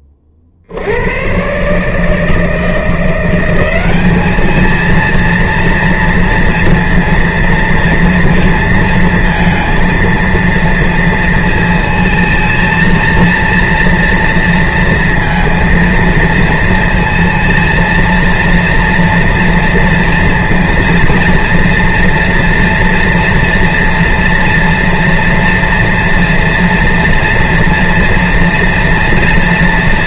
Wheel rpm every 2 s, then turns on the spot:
20, 150, 200, 230, 230, 230, 220, 230, 230, 230, 230, 230, 230, 230, 230.
none